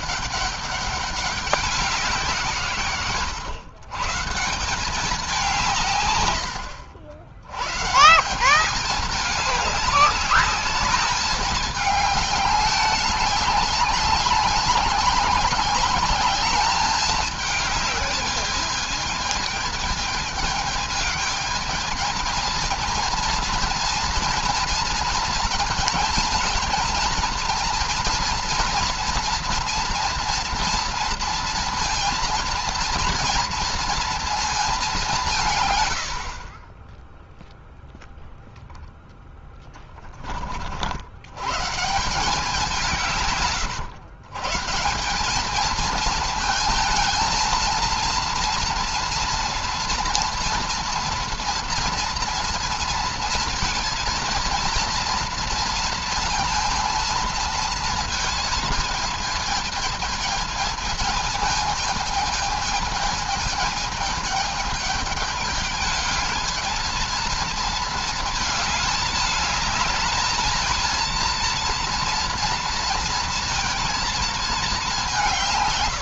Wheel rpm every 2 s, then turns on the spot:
200, 160, 170, 100, 180, 200, 200, 190, 200, 210, 220, 230, 230, 230, 230, 230, 230, 220, 30, 0, 30, 180, 160, 230, 230, 230, 230, 230, 230, 220, 220, 220, 220, 220, 220, 220, 230, 220.
none